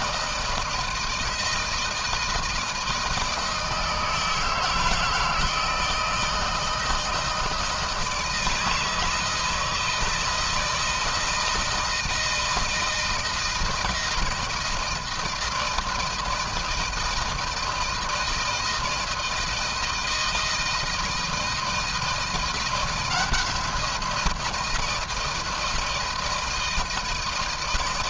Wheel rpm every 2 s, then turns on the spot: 160, 160, 160, 160, 160, 160, 160, 160, 160, 160, 160, 170, 170, 160.
none